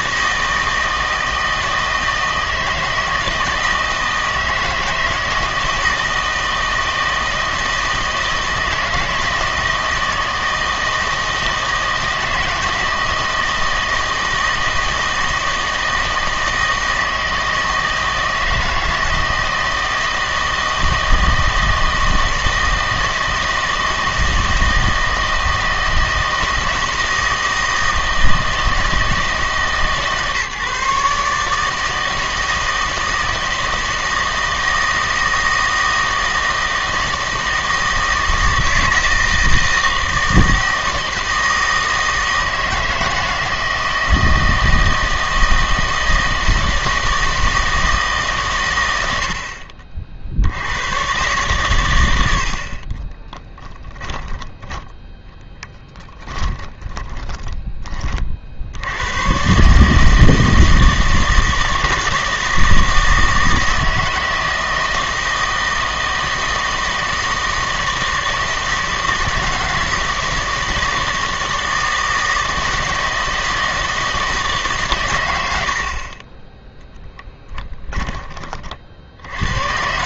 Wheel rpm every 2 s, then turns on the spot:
160, 160, 160, 160, 160, 160, 160, 160, 160, 160, 160, 160, 160, 160, 160, 150, 160, 160, 160, 160, 160, 160, 160, 160, 110, 100, 50, 10, 30, 80, 160, 160, 160, 160, 160, 160, 160, 150, 10, 50.
56-58 76-78